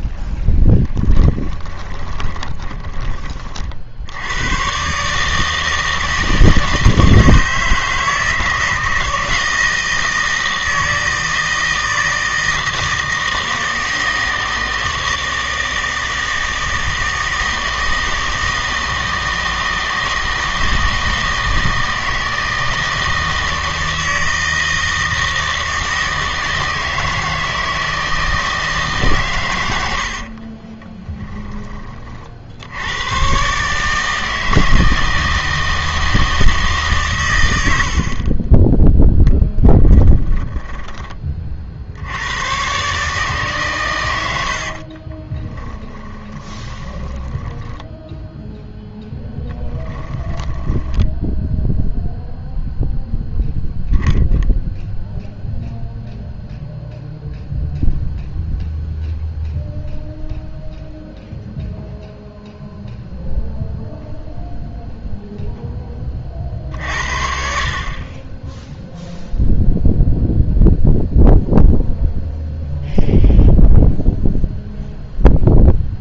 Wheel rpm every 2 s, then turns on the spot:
10, 30, 120, 160, 160, 160, 160, 160, 160, 160, 160, 160, 160, 160, 150, 30, 80, 160, 150, 10, 20, 130, 60, 20, 0, 10, 0, 0, 0, 0, 0, 0, 0, 50, 0, 0, 0, 0.
2-4 30-32 38-42 44-48 50-52